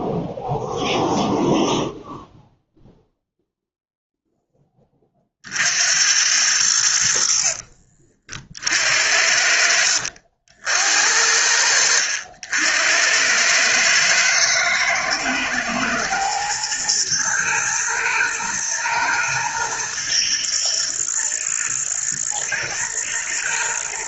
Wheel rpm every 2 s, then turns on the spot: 0, 0, 10, 80, 70, 60, 80, 110, 120, 120, 120, 110.
none